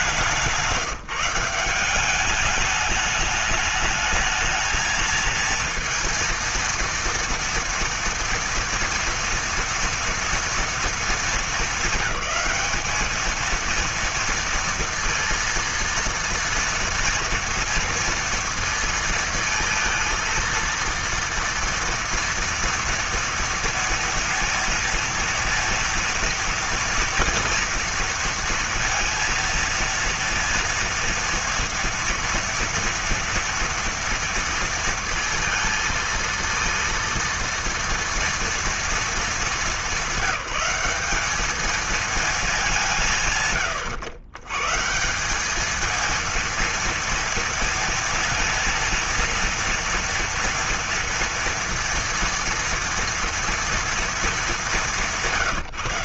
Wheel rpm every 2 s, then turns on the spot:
170, 210, 220, 230, 230, 230, 200, 230, 230, 230, 230, 230, 230, 230, 230, 240, 230, 230, 230, 230, 190, 160, 140, 230, 230, 230, 230, 200.
none